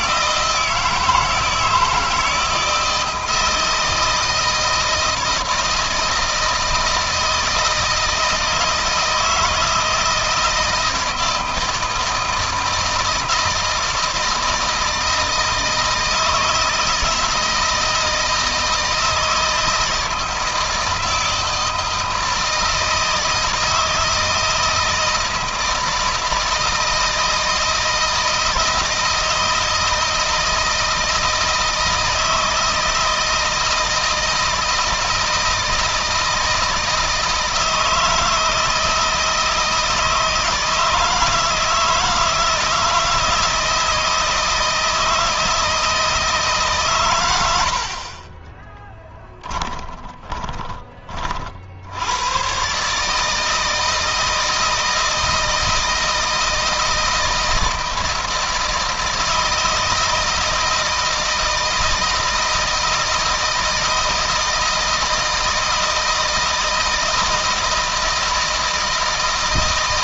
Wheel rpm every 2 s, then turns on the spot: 160, 160, 160, 160, 160, 160, 160, 160, 160, 160, 170, 160, 160, 160, 160, 160, 160, 160, 160, 160, 160, 160, 160, 130, 20, 30, 140, 160, 160, 170, 160, 160, 170, 160, 160.
48-50